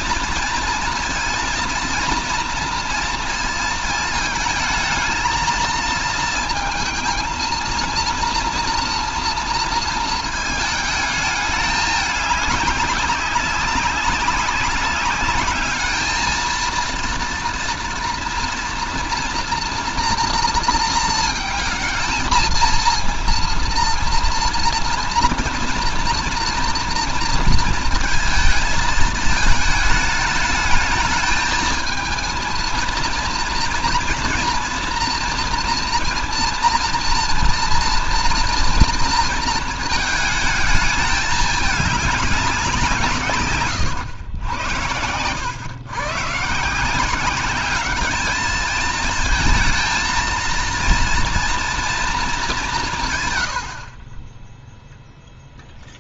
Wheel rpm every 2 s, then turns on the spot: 230, 230, 220, 220, 230, 220, 200, 190, 220, 230, 230, 230, 230, 230, 230, 220, 230, 230, 240, 230, 220, 190, 100, 150, 220, 230, 200, 10.
none